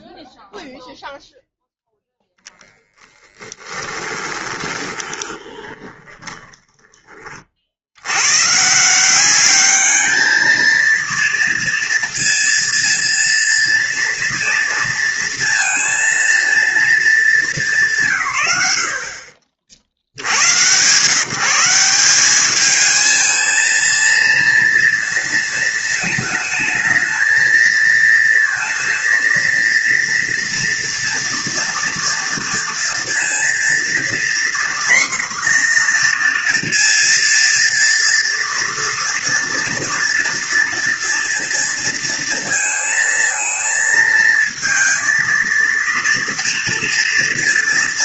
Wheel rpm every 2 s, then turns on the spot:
0, 0, 20, 20, 160, 230, 230, 230, 220, 70, 120, 220, 230, 220, 230, 230, 230, 250, 230, 230, 230, 230, 230, 230.
4-6